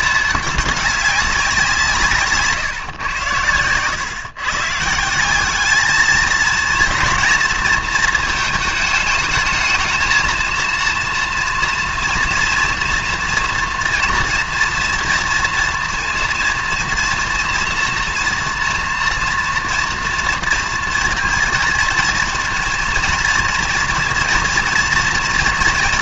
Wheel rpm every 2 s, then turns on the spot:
210, 140, 150, 230, 220, 230, 230, 230, 230, 230, 230, 230, 240.
none